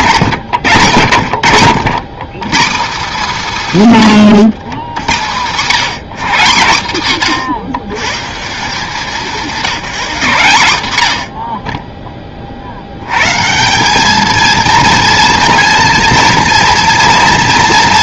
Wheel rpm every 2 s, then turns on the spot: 120, 180, 140, 170, 160, 140, 50, 230, 230.
none